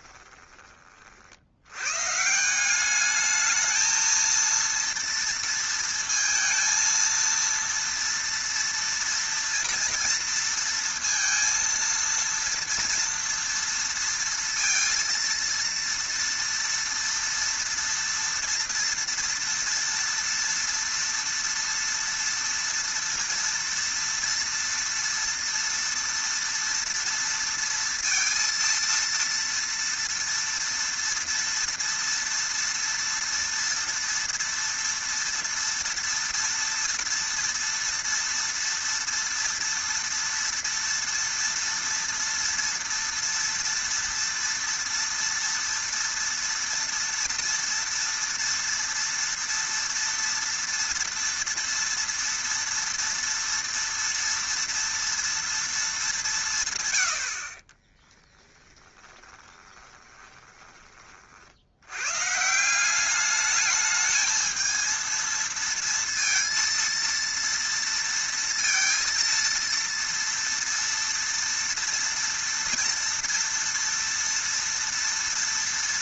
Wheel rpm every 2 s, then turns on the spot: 20, 190, 230, 230, 230, 230, 230, 230, 230, 230, 230, 230, 230, 230, 230, 230, 230, 230, 230, 230, 230, 230, 230, 230, 230, 230, 230, 230, 140, 20, 20, 160, 220, 230, 230, 230, 230, 230.
58-62